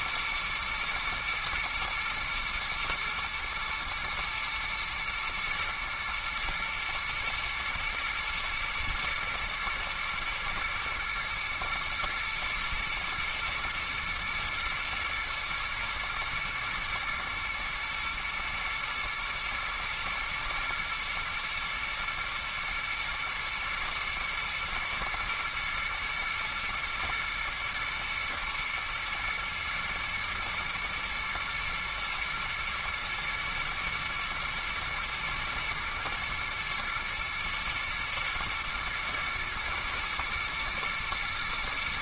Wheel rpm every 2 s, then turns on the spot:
110, 110, 110, 120, 110, 110, 110, 120, 110, 110, 110, 110, 110, 110, 110, 110, 110, 110, 120, 110, 120.
none